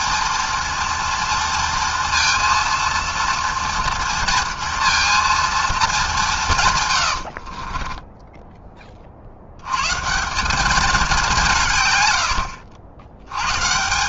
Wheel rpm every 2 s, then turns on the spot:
230, 230, 230, 170, 20, 200, 80.
none